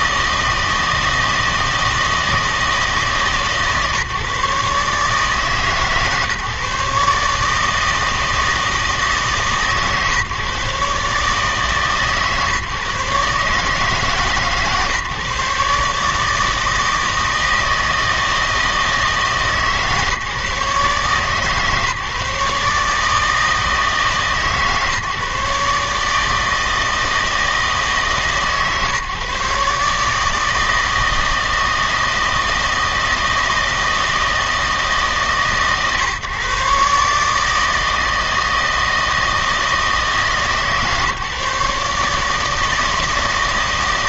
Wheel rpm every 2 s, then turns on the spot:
160, 160, 150, 150, 160, 140, 140, 150, 160, 160, 140, 150, 150, 160, 140, 160, 160, 150, 140, 160, 150, 160.
none